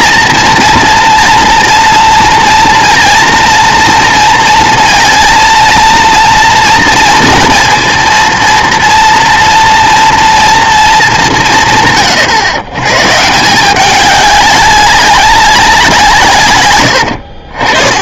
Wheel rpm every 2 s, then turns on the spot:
230, 230, 230, 230, 230, 230, 120, 200, 120.
none